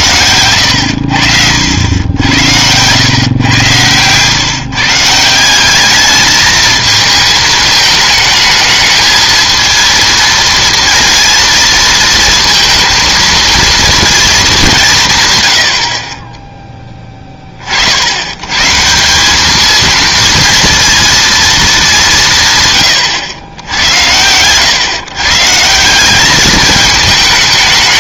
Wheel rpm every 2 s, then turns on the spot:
90, 90, 140, 220, 210, 230, 230, 200, 20, 120, 230, 140, 110, 210.
none